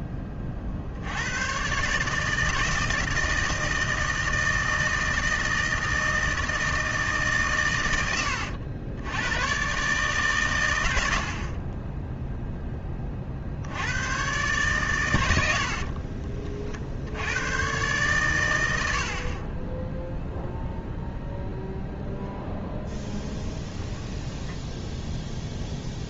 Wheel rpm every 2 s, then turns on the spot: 60, 160, 160, 160, 90, 100, 10, 120, 60, 90, 0, 0, 0.
none